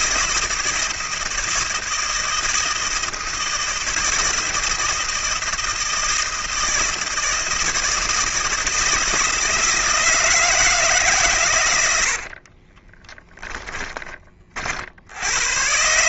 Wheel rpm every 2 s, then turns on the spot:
160, 160, 160, 160, 160, 160, 30, 60.
12-14